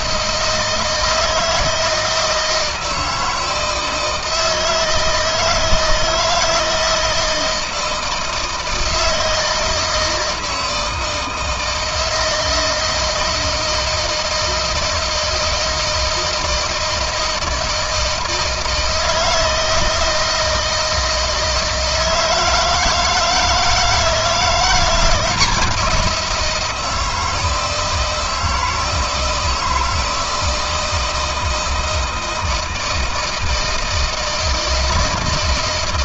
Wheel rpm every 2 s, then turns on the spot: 160, 160, 160, 160, 160, 160, 160, 160, 160, 160, 160, 160, 170, 170, 160, 160, 160, 160.
none